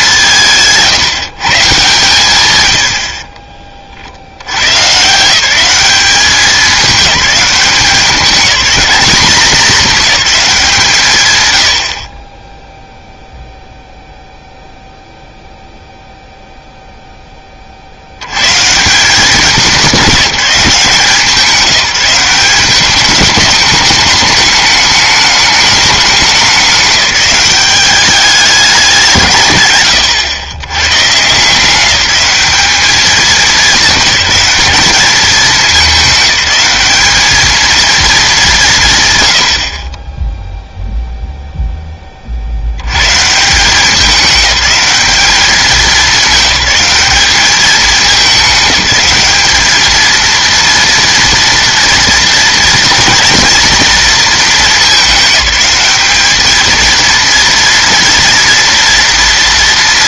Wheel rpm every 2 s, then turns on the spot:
160, 100, 110, 200, 210, 190, 10, 0, 0, 140, 180, 200, 210, 200, 200, 120, 210, 210, 190, 180, 0, 70, 200, 210, 200, 230, 230, 220, 220, 240.
none